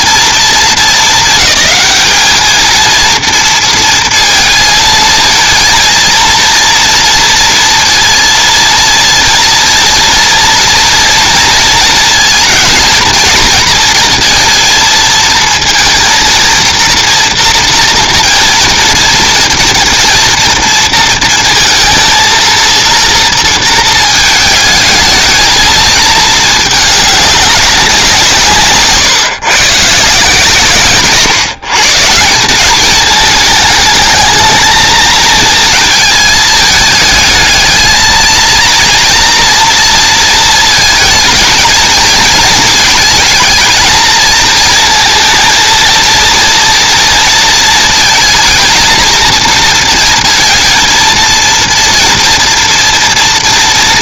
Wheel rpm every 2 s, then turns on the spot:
220, 210, 230, 230, 230, 230, 220, 230, 230, 230, 230, 230, 220, 220, 170, 140, 200, 220, 220, 230, 230, 220, 220, 230, 230, 230, 230.
none